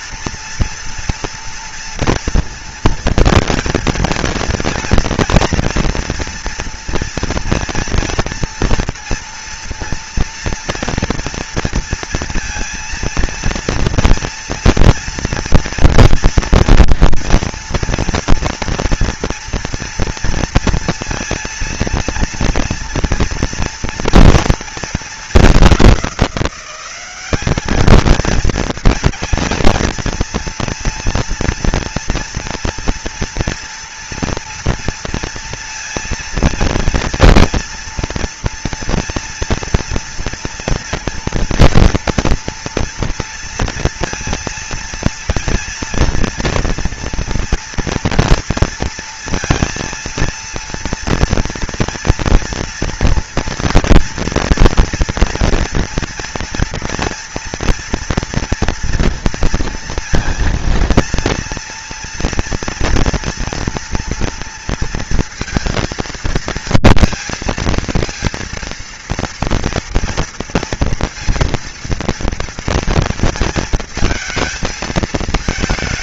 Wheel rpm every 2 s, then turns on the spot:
230, 230, 230, 230, 230, 230, 230, 230, 230, 230, 230, 230, 230, 190, 230, 230, 230, 230, 230, 230, 230, 230, 230, 230, 230, 230, 230, 240, 230, 230, 230, 240, 230, 230, 230, 230, 230, 220.
none